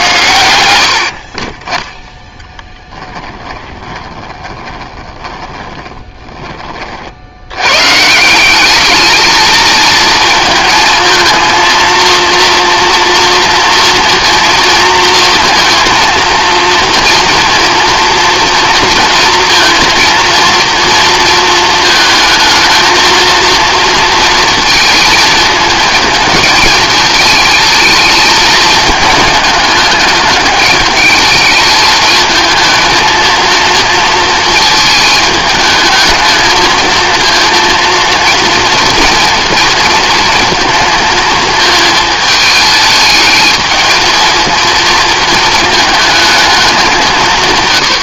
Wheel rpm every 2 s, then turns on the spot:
90, 10, 20, 30, 200, 220, 230, 230, 230, 230, 230, 220, 230, 220, 220, 210, 220, 220, 220, 230, 230, 220, 230, 210.
2-6